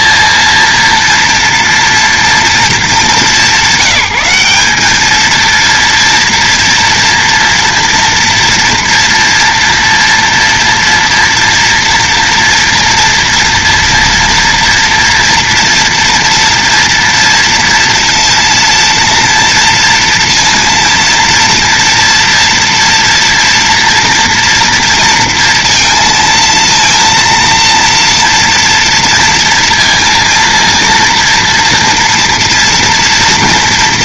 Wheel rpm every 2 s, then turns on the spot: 230, 220, 200, 230, 230, 230, 230, 230, 230, 230, 230, 230, 230, 230, 230, 230, 230.
none